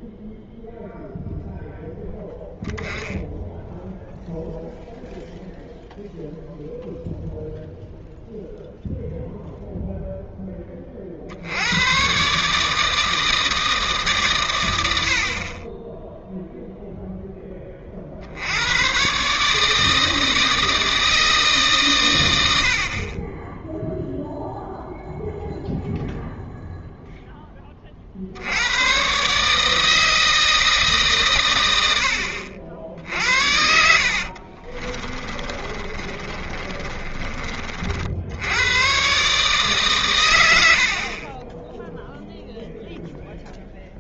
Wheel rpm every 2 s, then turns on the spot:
0, 10, 0, 0, 0, 30, 150, 80, 0, 110, 160, 60, 0, 0, 110, 160, 70, 40, 30, 110, 60, 0.
34-38